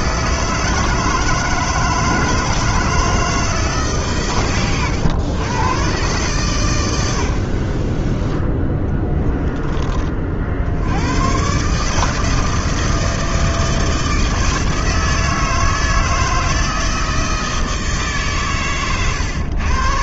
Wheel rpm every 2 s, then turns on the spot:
160, 160, 120, 120, 10, 70, 160, 160, 160, 120.
8-10